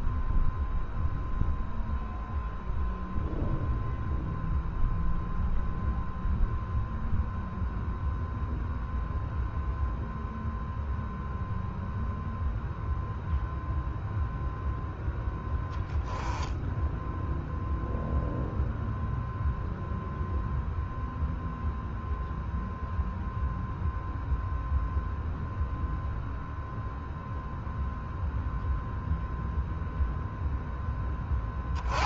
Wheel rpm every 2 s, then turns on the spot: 0, 0, 0, 0, 0, 0, 0, 0, 0, 0, 0, 0, 0, 0, 0, 10.
none